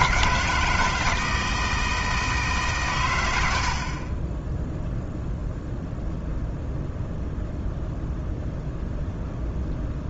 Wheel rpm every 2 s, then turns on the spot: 160, 120, 0, 0, 0.
none